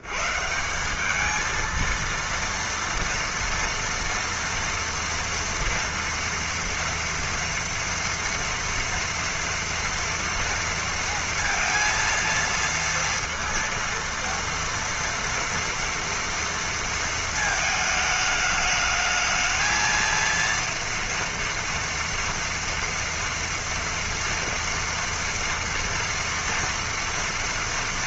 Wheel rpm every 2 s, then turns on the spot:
80, 230, 230, 230, 230, 230, 230, 230, 230, 220, 230, 230, 230, 230.
none